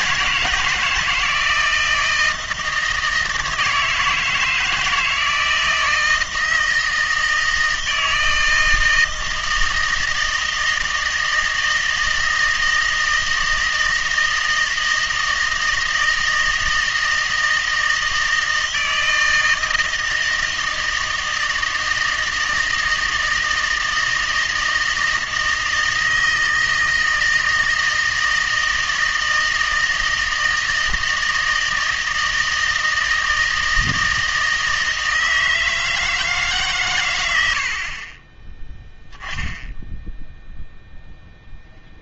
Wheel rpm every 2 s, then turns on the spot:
160, 160, 160, 160, 160, 160, 160, 160, 160, 160, 160, 160, 160, 160, 160, 160, 160, 160, 140, 0, 0.
none